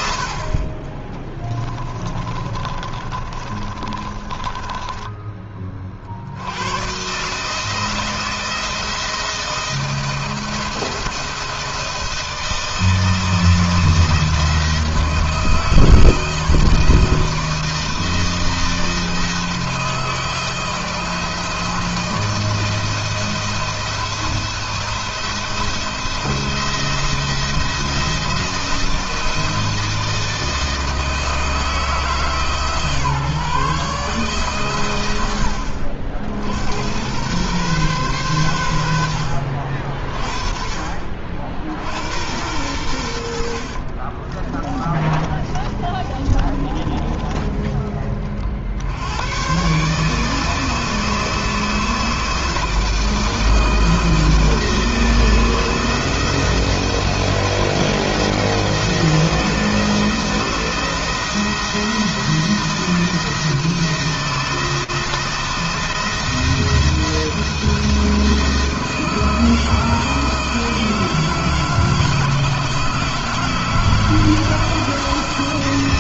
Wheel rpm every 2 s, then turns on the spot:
30, 30, 20, 120, 160, 170, 160, 160, 160, 160, 160, 160, 170, 170, 160, 160, 150, 120, 90, 80, 50, 90, 30, 30, 90, 160, 160, 160, 170, 170, 170, 160, 160, 160, 160, 160, 160, 170.
0-6 44-48